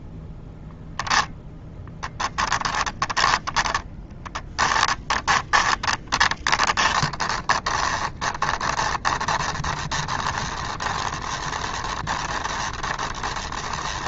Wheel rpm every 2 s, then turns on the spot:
0, 20, 10, 20, 20, 20, 20.
2-14